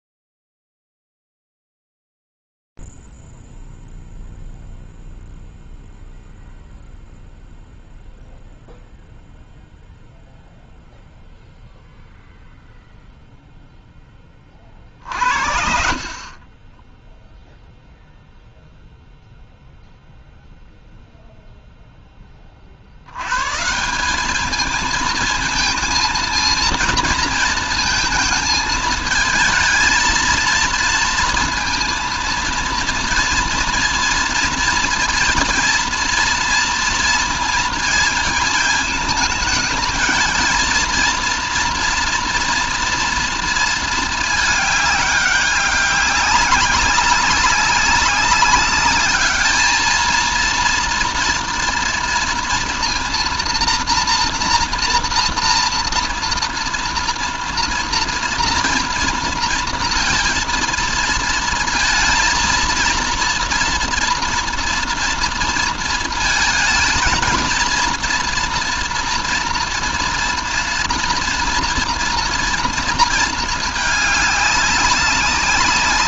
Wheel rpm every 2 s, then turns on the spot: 0, 0, 0, 0, 0, 0, 0, 30, 30, 0, 0, 50, 220, 220, 220, 230, 230, 230, 230, 220, 230, 230, 210, 200, 200, 230, 230, 230, 230, 230, 230, 230, 230, 230, 230, 230, 230, 200.
none